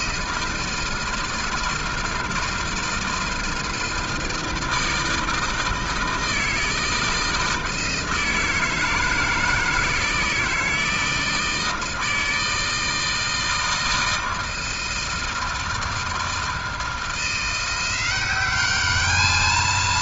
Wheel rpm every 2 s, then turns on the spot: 160, 160, 160, 160, 160, 160, 160, 160, 160, 190.
none